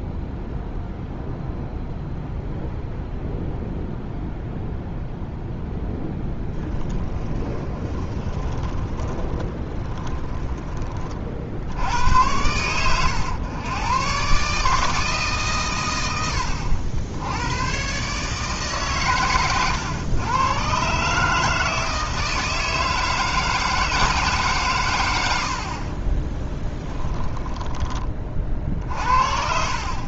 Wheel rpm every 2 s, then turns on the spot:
0, 0, 0, 20, 10, 30, 100, 150, 80, 140, 130, 160, 110, 10, 50.
6-10 26-28